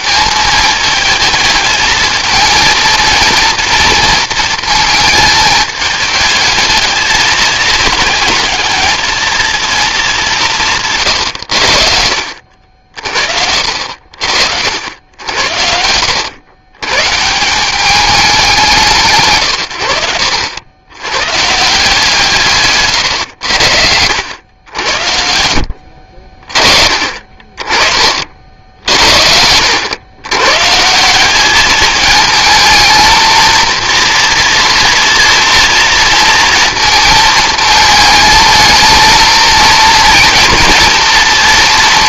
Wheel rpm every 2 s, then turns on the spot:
220, 220, 220, 220, 220, 140, 60, 70, 120, 190, 80, 140, 80, 30, 60, 130, 220, 240, 230, 220, 230.
22-24